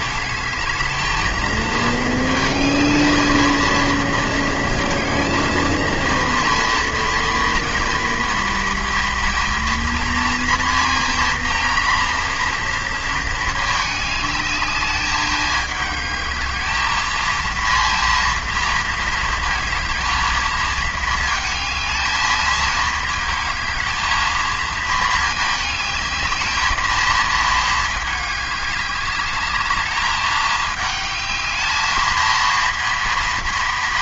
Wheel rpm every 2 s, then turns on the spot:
210, 220, 230, 230, 230, 230, 230, 210, 210, 230, 220, 220, 220, 220, 200, 210, 230.
none